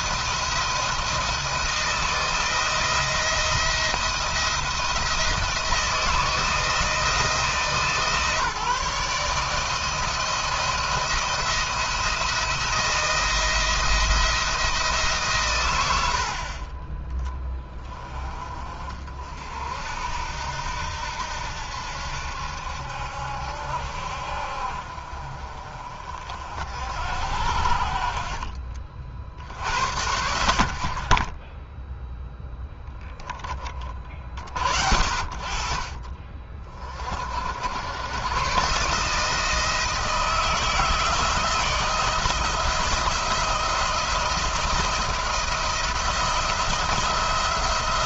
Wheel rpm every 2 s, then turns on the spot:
160, 170, 170, 160, 150, 170, 160, 160, 30, 40, 80, 70, 50, 70, 50, 70, 0, 50, 30, 140, 160, 170, 170, 170.
30-32